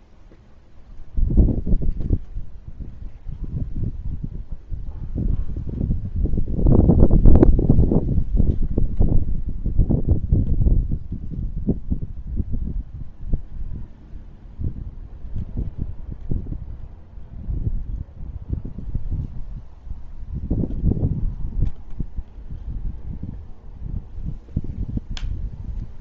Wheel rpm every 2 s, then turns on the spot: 0, 0, 0, 0, 0, 0, 0, 0, 0, 0, 0, 0, 0.
none